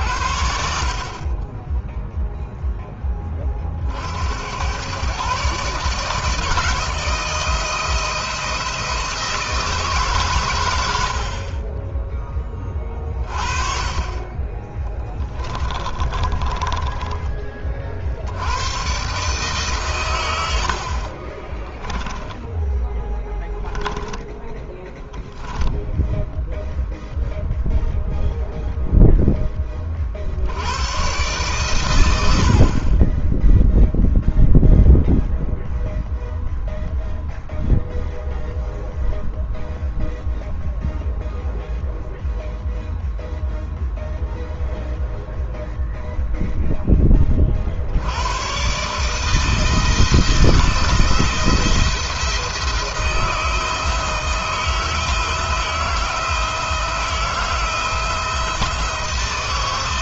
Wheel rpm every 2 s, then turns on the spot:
20, 40, 150, 170, 160, 30, 30, 20, 20, 130, 20, 10, 0, 0, 0, 110, 10, 0, 0, 0, 0, 0, 0, 20, 150, 170, 160, 160, 160, 160.
14-16 20-24